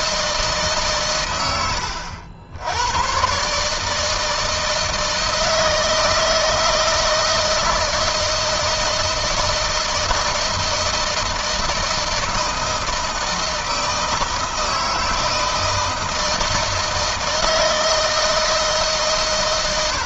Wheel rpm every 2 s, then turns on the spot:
130, 100, 160, 160, 160, 160, 160, 160, 160, 140.
none